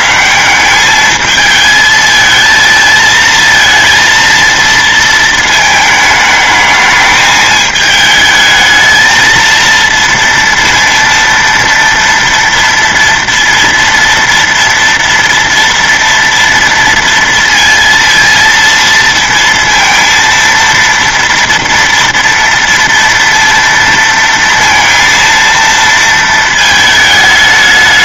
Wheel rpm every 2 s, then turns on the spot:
190, 220, 230, 220, 220, 230, 230, 240, 230, 230, 230, 230, 230, 220.
none